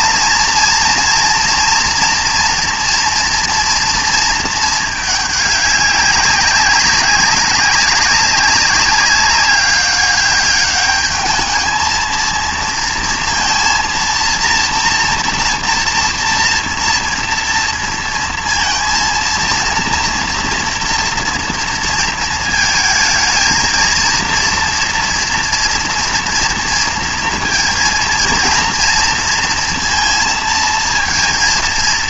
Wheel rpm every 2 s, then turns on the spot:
230, 240, 220, 200, 200, 200, 230, 240, 240, 230, 230, 220, 230, 230, 230, 230.
none